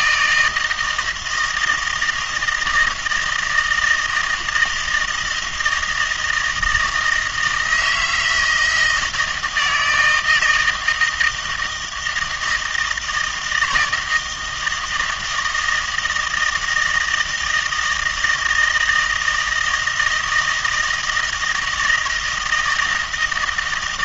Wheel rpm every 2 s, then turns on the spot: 160, 160, 160, 160, 160, 160, 160, 160, 160, 160, 160, 170.
none